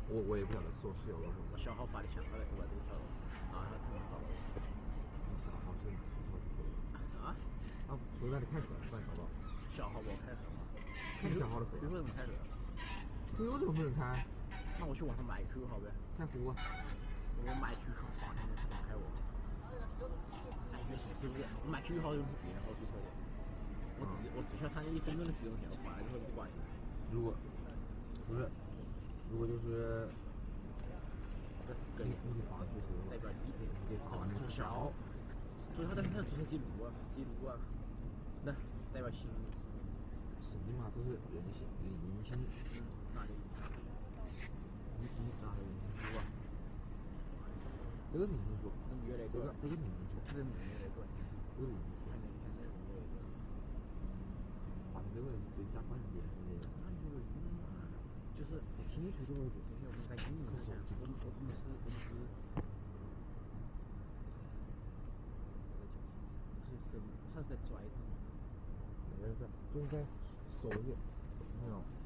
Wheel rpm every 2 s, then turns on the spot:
0, 0, 0, 0, 0, 0, 0, 0, 0, 0, 0, 0, 0, 0, 0, 0, 0, 0, 0, 0, 0, 0, 0, 0, 0, 0, 0, 0, 0, 0, 0, 0, 0, 0, 0, 0.
none